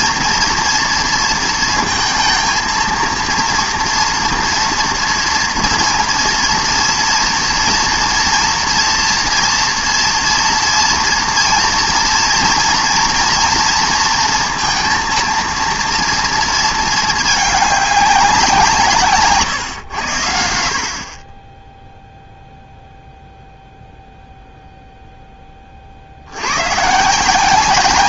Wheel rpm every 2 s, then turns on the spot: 230, 230, 230, 230, 230, 230, 240, 230, 230, 180, 70, 0, 0, 110.
none